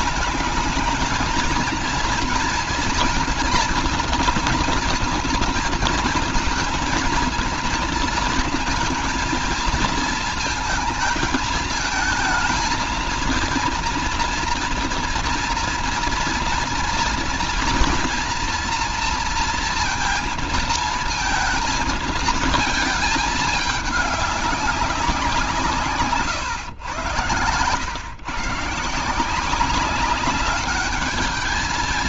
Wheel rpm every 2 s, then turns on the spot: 220, 230, 240, 230, 230, 220, 220, 240, 230, 230, 230, 220, 200, 130, 130, 200.
none